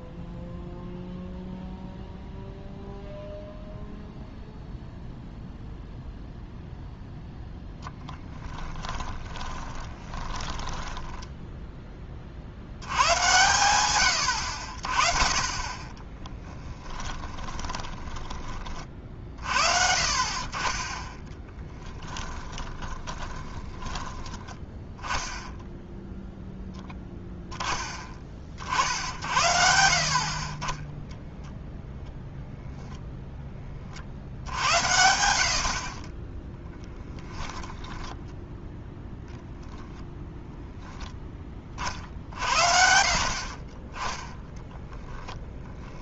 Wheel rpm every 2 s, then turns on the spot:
0, 0, 0, 0, 20, 20, 80, 60, 20, 40, 20, 30, 10, 0, 50, 20, 0, 80, 10, 0, 10, 60, 10.
8-12 16-18 22-24 36-38 44-46